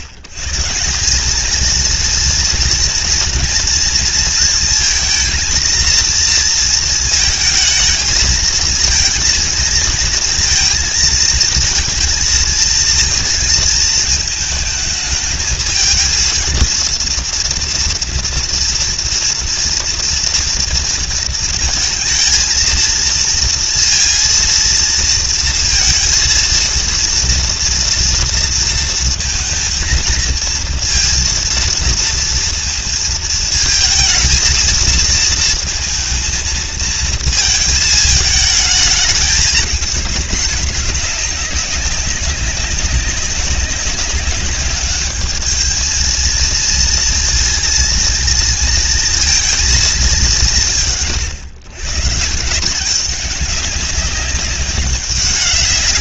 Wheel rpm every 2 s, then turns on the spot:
140, 230, 230, 230, 220, 230, 230, 220, 230, 230, 230, 230, 230, 230, 230, 230, 230, 230, 230, 210, 210, 190, 210, 230, 230, 150, 180, 200.
none